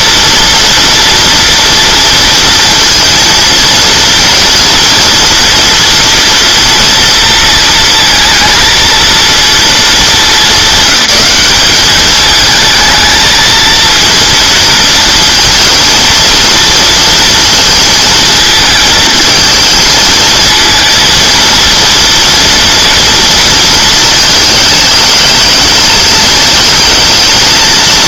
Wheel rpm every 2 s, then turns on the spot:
240, 230, 230, 230, 230, 200, 220, 230, 230, 220, 230, 230, 210, 220.
none